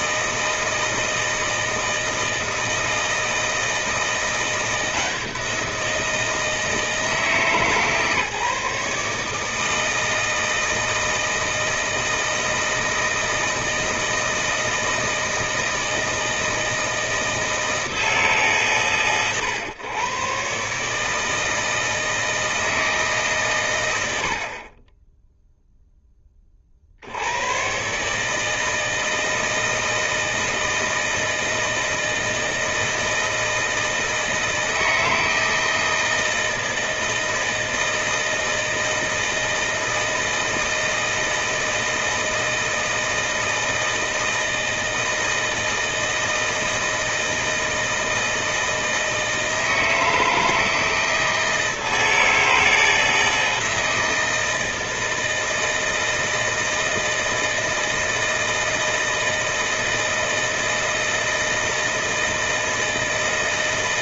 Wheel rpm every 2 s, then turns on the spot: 160, 160, 170, 160, 150, 160, 160, 160, 160, 140, 150, 150, 20, 60, 160, 160, 160, 160, 160, 160, 160, 160, 160, 160, 160, 160, 160, 160, 160, 160, 160, 160.
none